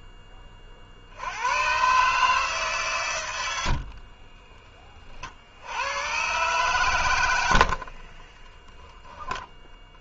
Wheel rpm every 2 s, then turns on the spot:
30, 150, 20, 120, 0.
none